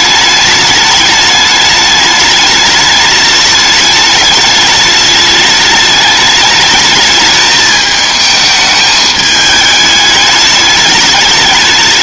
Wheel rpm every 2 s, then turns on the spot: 210, 210, 210, 210, 210, 210.
none